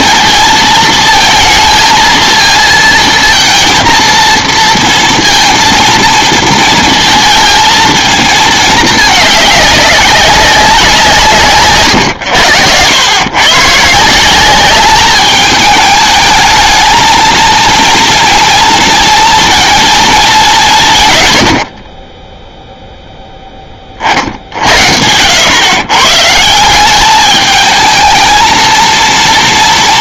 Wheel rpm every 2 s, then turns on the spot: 230, 230, 230, 230, 220, 180, 100, 200, 220, 230, 170, 0, 70, 180, 230.
none